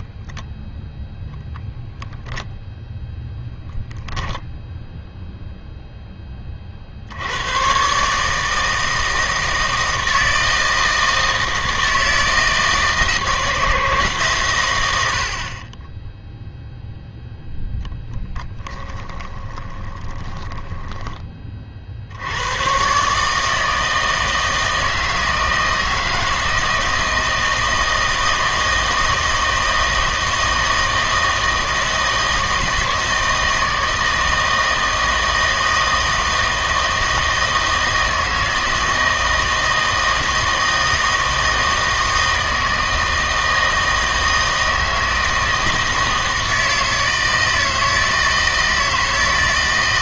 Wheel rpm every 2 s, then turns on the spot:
0, 0, 10, 30, 160, 160, 160, 110, 0, 10, 10, 110, 160, 160, 160, 160, 160, 160, 160, 160, 160, 160, 160, 160, 160.
18-22